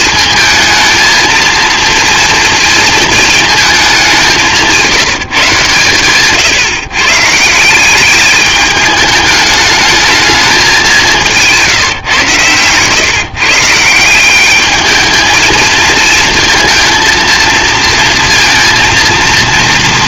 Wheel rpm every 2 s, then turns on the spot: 230, 230, 170, 140, 210, 190, 140, 220, 230, 230.
none